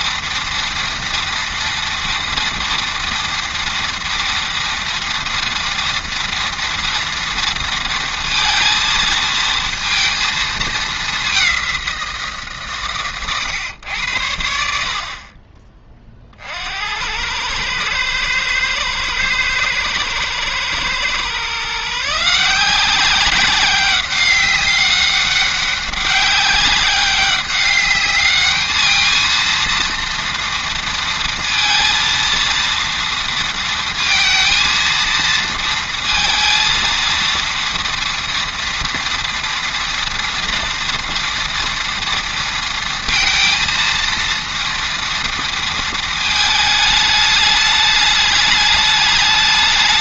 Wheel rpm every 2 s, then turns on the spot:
230, 230, 230, 230, 230, 220, 140, 60, 70, 110, 120, 180, 200, 190, 210, 230, 230, 230, 230, 230, 230, 230, 230, 220, 210.
none